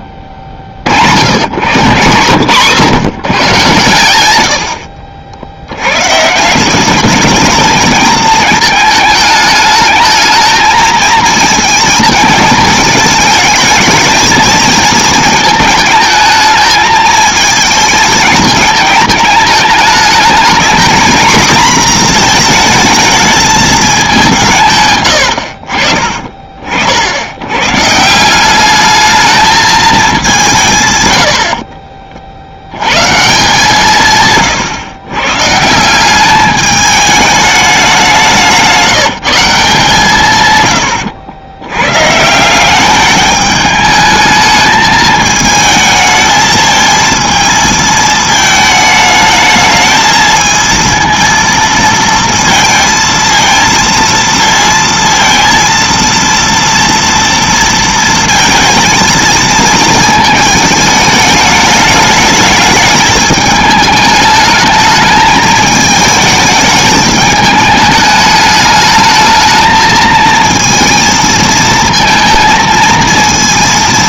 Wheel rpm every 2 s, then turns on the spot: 150, 110, 120, 220, 210, 220, 220, 220, 220, 210, 230, 200, 50, 140, 210, 30, 160, 160, 200, 160, 100, 210, 220, 220, 220, 230, 230, 230, 230, 220, 210, 210, 220, 210, 220, 230, 230.
none